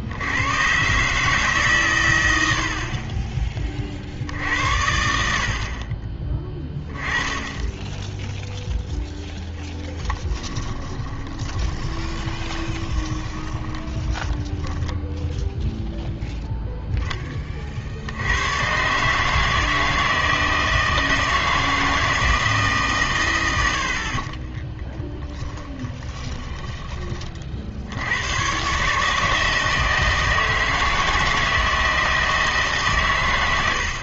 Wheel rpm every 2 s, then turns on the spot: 120, 50, 80, 20, 0, 20, 20, 10, 0, 120, 160, 150, 10, 20, 130, 160, 150.
10-16 24-28